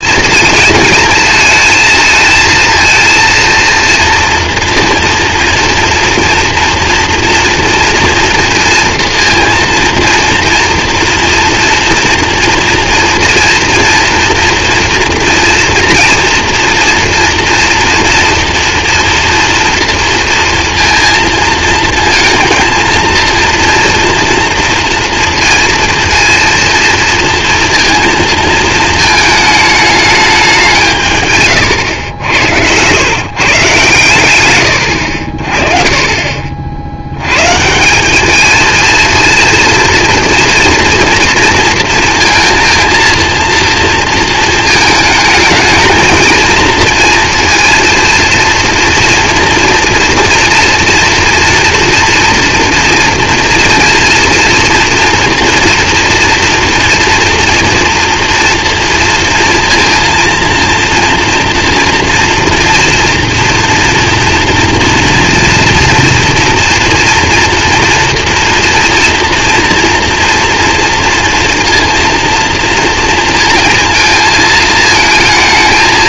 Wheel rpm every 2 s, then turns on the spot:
230, 230, 230, 230, 230, 230, 230, 240, 230, 230, 230, 230, 230, 230, 230, 170, 100, 110, 60, 220, 230, 230, 230, 230, 230, 230, 230, 240, 230, 230, 230, 230, 240, 230, 230, 230, 230, 220.
none